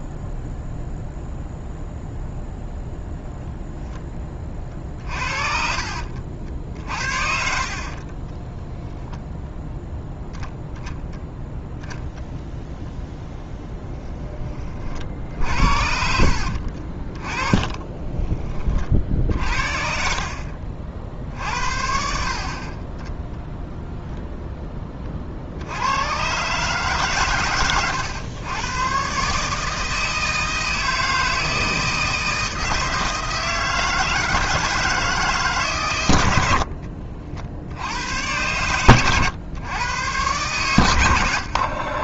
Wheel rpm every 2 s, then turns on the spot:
0, 0, 30, 60, 20, 0, 0, 30, 60, 40, 50, 40, 10, 130, 120, 160, 160, 160, 70, 110, 110.
8-10 16-18